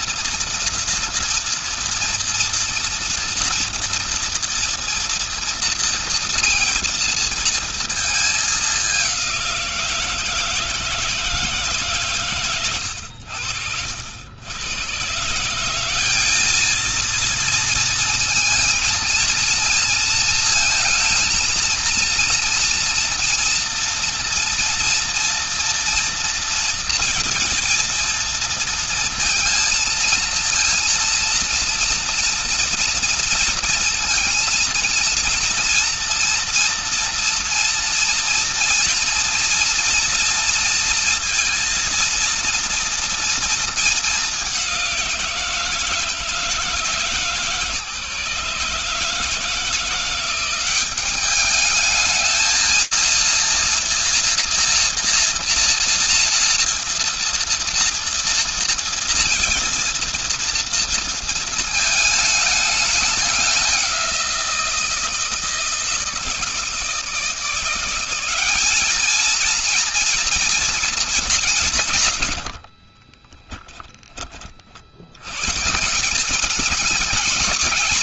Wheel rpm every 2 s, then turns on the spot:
240, 230, 230, 230, 210, 160, 100, 110, 220, 230, 220, 230, 230, 230, 230, 230, 240, 230, 230, 230, 230, 230, 190, 160, 150, 180, 220, 240, 230, 230, 230, 210, 170, 160, 220, 210, 30, 90, 200.
72-74